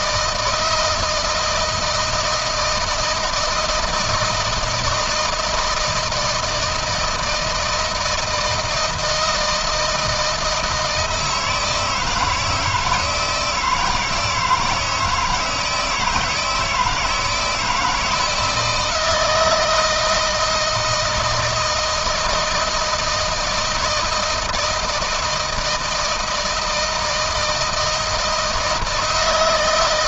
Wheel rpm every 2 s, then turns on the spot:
160, 170, 160, 160, 160, 160, 160, 160, 160, 160, 160, 160, 160, 160, 160.
none